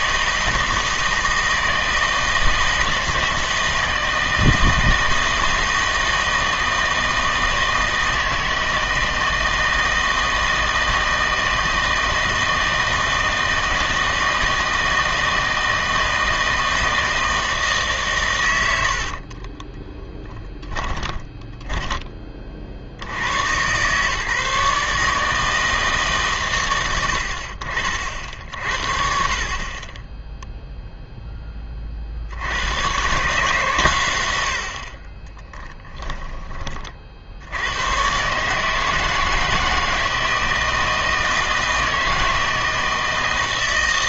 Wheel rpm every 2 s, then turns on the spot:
160, 160, 160, 160, 160, 160, 160, 160, 160, 90, 10, 50, 150, 120, 60, 0, 90, 70, 30, 150, 160, 160.
20-22